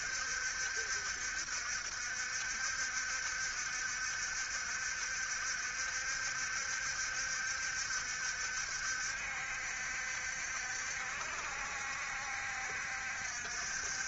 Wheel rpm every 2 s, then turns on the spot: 70, 70, 70, 70, 70, 70, 60.
none